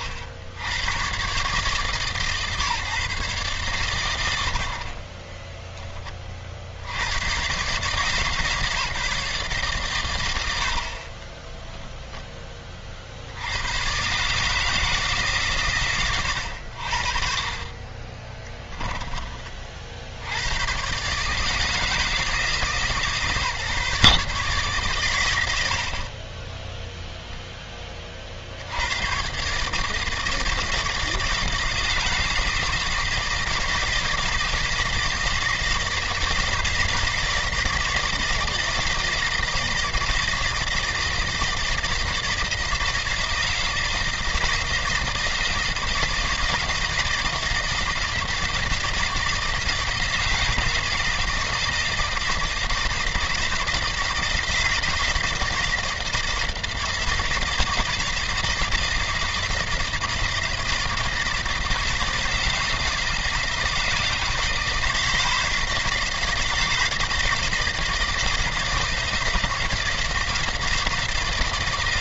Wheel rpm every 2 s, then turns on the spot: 80, 150, 60, 50, 150, 70, 30, 160, 70, 10, 100, 160, 140, 10, 90, 160, 160, 160, 160, 160, 160, 160, 160, 160, 160, 160, 160, 160, 160, 160, 160, 160, 160, 160, 160, 160.
18-20